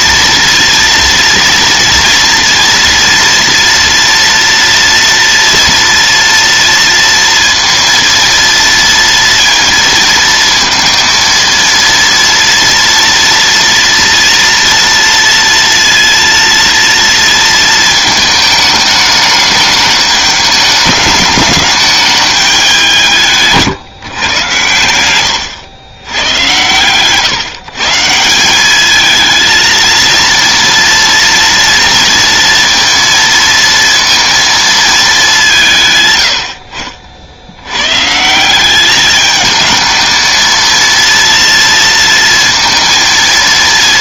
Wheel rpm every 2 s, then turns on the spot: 230, 230, 230, 230, 230, 230, 230, 230, 230, 210, 210, 190, 100, 130, 210, 230, 230, 210, 50, 200, 230, 230.
none